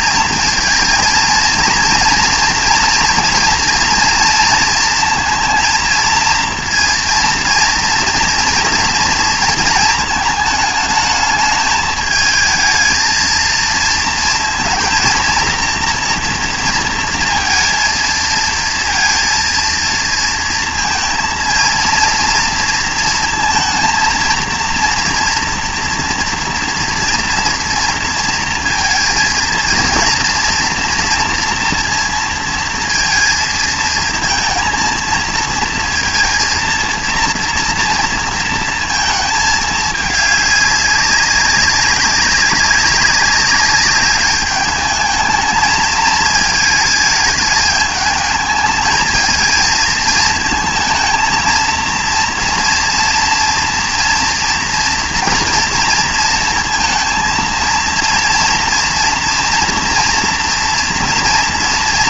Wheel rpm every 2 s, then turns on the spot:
230, 230, 230, 230, 240, 220, 220, 230, 230, 230, 230, 230, 230, 230, 230, 230, 230, 230, 230, 230, 210, 200, 200, 220, 220, 220, 230, 230, 230, 230, 230.
none